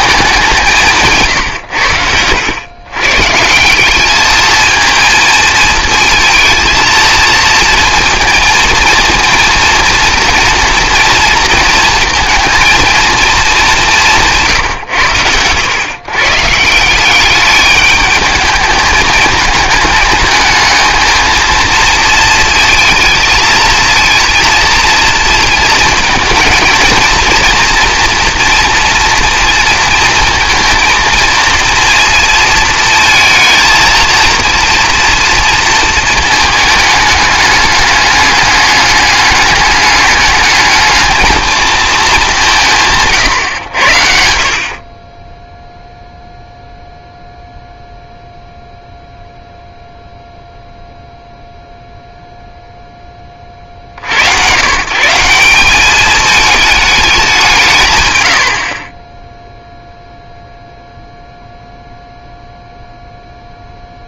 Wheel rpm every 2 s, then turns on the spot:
200, 100, 220, 230, 230, 230, 230, 140, 160, 210, 220, 220, 230, 230, 230, 230, 230, 230, 220, 210, 210, 170, 50, 0, 0, 0, 0, 110, 210, 60, 0, 0.
none